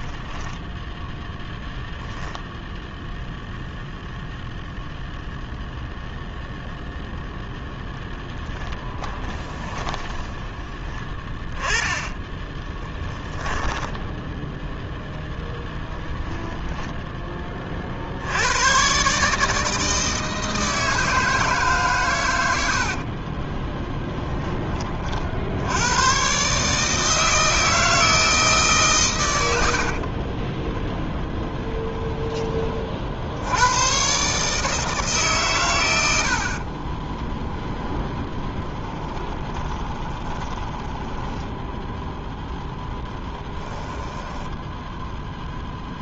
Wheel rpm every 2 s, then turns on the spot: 10, 0, 0, 0, 10, 20, 10, 0, 10, 120, 160, 60, 40, 150, 140, 10, 30, 150, 20, 10, 10, 10, 10.
8-10 12-14 22-24 30-32 36-42